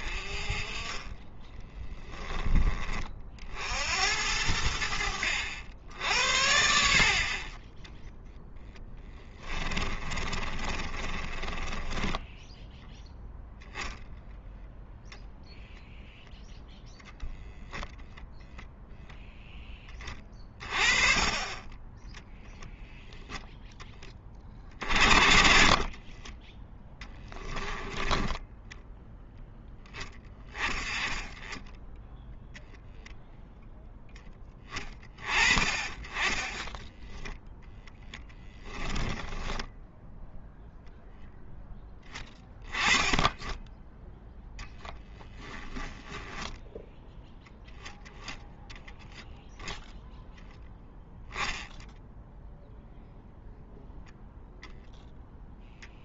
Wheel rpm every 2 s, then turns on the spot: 20, 20, 80, 70, 10, 30, 0, 0, 0, 0, 30, 0, 40, 10, 20, 10, 0, 20, 10, 10, 0, 20, 0, 0, 0, 0, 0, 0.
8-12 28-30 38-40